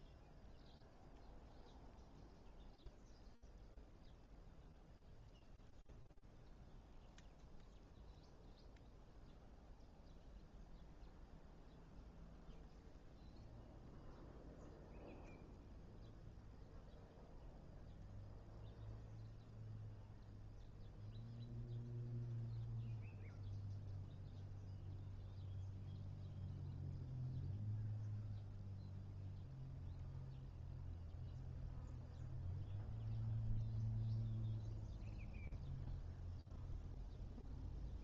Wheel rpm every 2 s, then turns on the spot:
0, 0, 0, 0, 0, 0, 0, 0, 0, 0, 0, 0, 0, 0, 0, 0, 0, 0, 0.
none